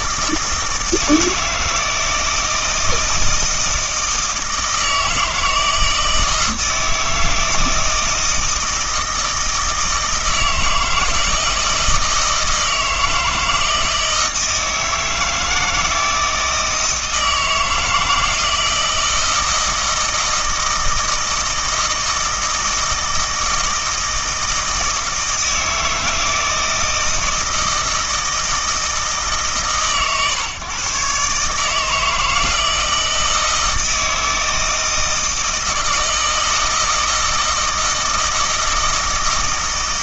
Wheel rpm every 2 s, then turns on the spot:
160, 160, 160, 160, 160, 160, 160, 160, 160, 160, 160, 160, 160, 160, 160, 140, 160, 160, 160, 160.
none